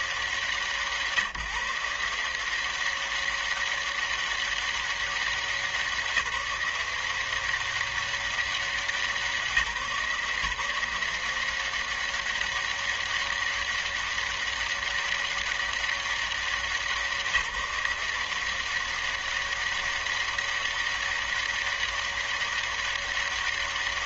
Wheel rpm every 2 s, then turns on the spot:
180, 160, 200, 170, 190, 160, 190, 200, 190, 170, 200, 200.
none